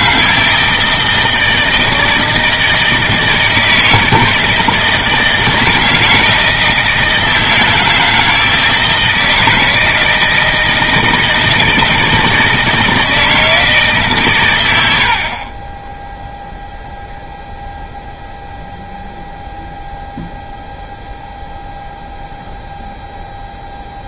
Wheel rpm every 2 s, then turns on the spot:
160, 160, 160, 160, 160, 160, 160, 100, 0, 0, 0, 0.
none